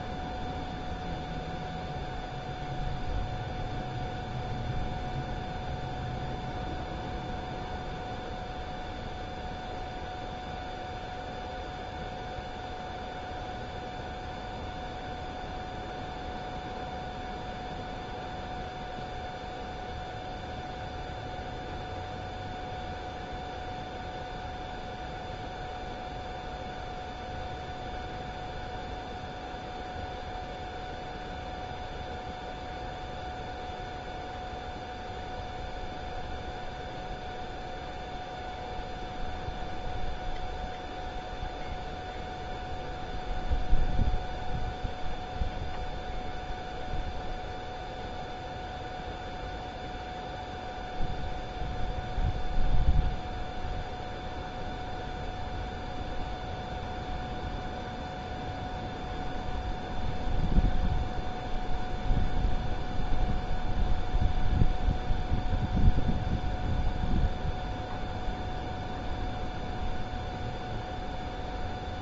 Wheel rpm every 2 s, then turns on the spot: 0, 0, 0, 0, 0, 0, 0, 0, 0, 0, 0, 0, 0, 0, 0, 0, 0, 0, 0, 0, 0, 0, 0, 0, 0, 0, 0, 0, 0, 0, 0, 0, 0, 0, 0, 0.
none